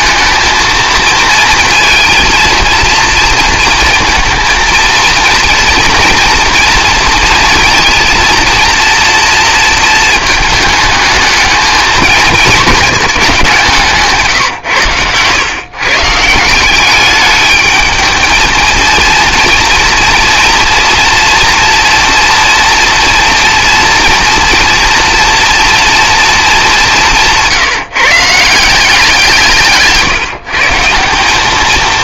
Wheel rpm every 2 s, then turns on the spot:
230, 230, 230, 230, 230, 210, 210, 120, 180, 230, 230, 230, 230, 200, 170, 160.
none